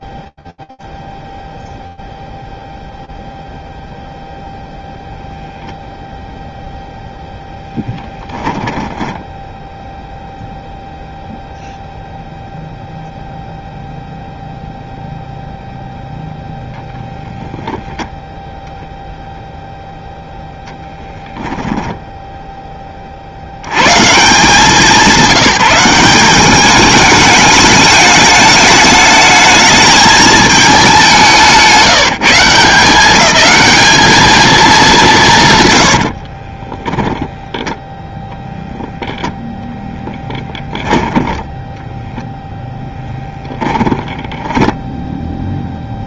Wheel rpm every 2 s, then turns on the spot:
0, 0, 0, 10, 0, 0, 0, 10, 0, 10, 0, 140, 190, 210, 220, 160, 220, 60, 0, 10, 10, 10, 0.
34-36 40-44